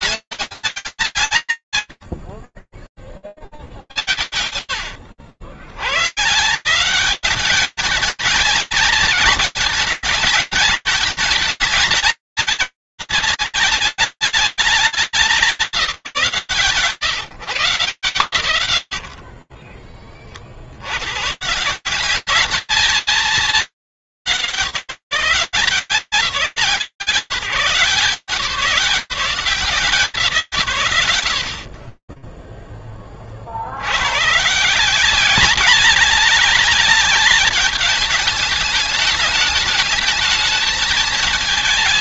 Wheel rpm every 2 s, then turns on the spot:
10, 110, 150, 210, 230, 220, 220, 210, 170, 40, 140, 220, 170, 160, 180, 160, 20, 150, 210, 220, 220.
18-20